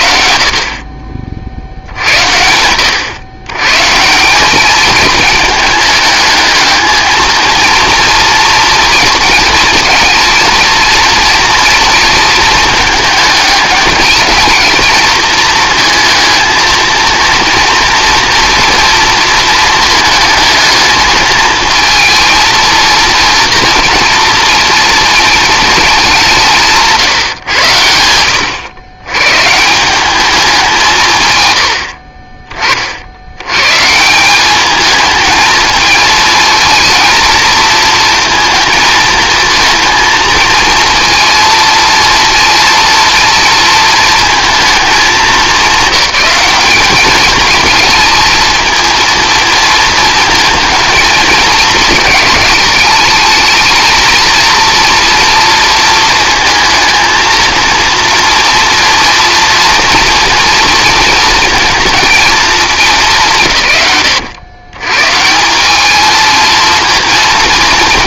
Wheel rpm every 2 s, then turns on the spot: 60, 90, 210, 220, 230, 230, 220, 220, 230, 230, 220, 220, 230, 160, 100, 180, 40, 210, 230, 230, 230, 230, 220, 210, 220, 230, 210, 230, 230, 230, 230, 200, 110, 230.
none